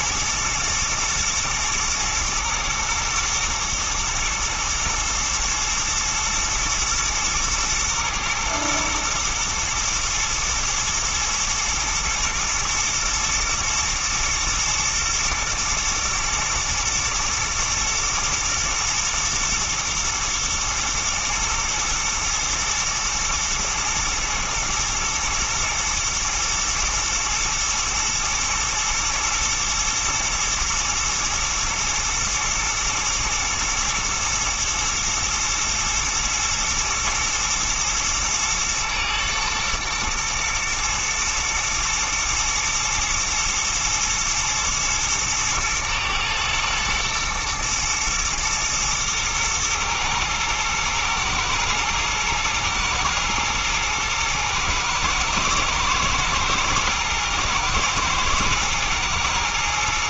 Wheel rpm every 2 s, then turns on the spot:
120, 120, 120, 110, 110, 110, 110, 120, 120, 110, 120, 110, 110, 110, 110, 110, 110, 110, 110, 120, 120, 110, 110, 110, 110, 110, 110, 110, 110, 110.
none